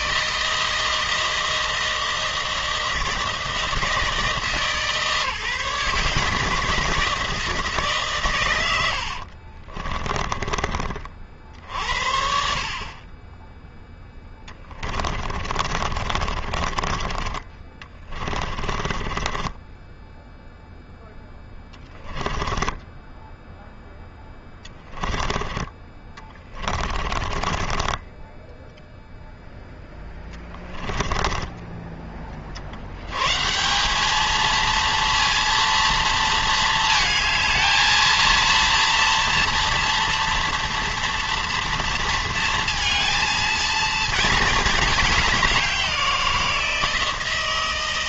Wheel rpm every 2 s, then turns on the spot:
160, 160, 150, 170, 70, 40, 20, 30, 30, 30, 0, 10, 10, 30, 10, 30, 80, 230, 220, 230, 230, 230, 210, 170.
8-10 14-20 22-24 26-28